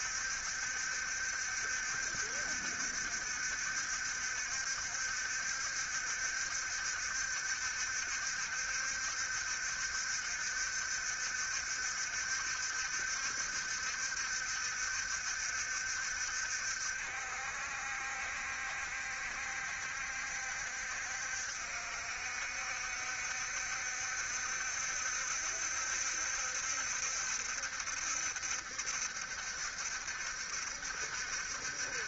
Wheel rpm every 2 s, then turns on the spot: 70, 60, 70, 70, 70, 70, 70, 70, 60, 70, 60, 70, 70, 70, 70, 60.
none